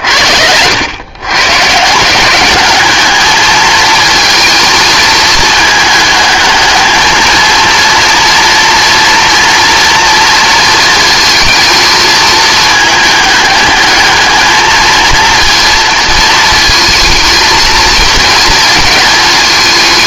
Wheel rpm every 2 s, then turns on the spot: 100, 200, 220, 220, 230, 230, 210, 220, 230, 220.
none